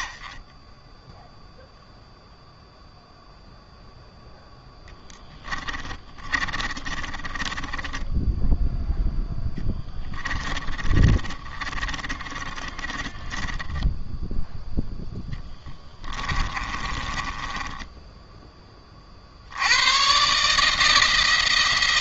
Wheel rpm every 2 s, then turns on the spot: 0, 0, 10, 20, 0, 30, 20, 20, 10, 80, 170.
4-8 10-18